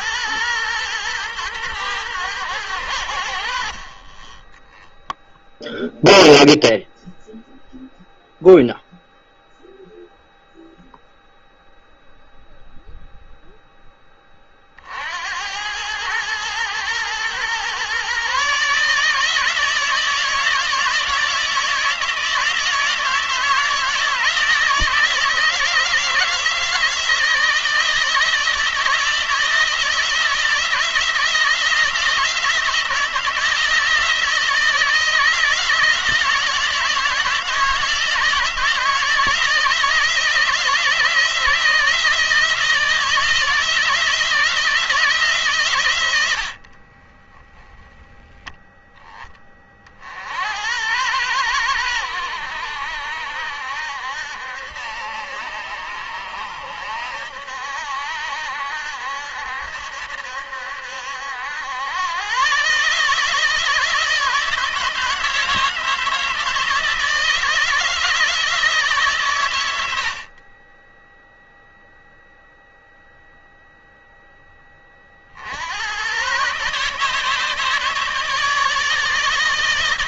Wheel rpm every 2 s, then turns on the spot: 110, 100, 10, 0, 0, 0, 0, 40, 110, 150, 160, 160, 160, 160, 160, 160, 160, 160, 160, 160, 160, 160, 160, 50, 10, 70, 80, 70, 70, 70, 70, 120, 160, 160, 150, 30, 0, 20, 140, 150.
46-48